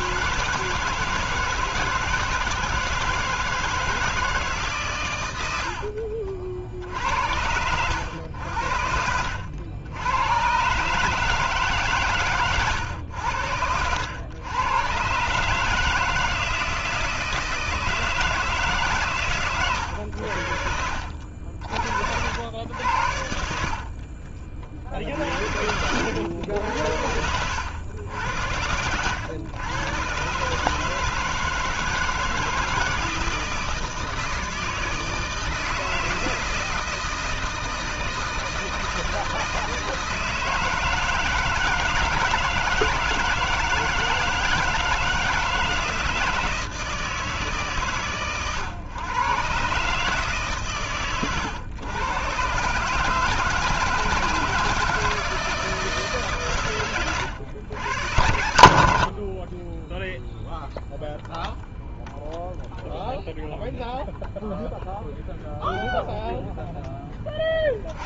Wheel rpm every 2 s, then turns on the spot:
160, 160, 110, 70, 80, 150, 100, 140, 160, 140, 60, 80, 40, 90, 90, 160, 160, 160, 160, 160, 160, 160, 160, 160, 110, 140, 130, 160, 130, 80, 0, 0, 0, 0.
12-14 20-22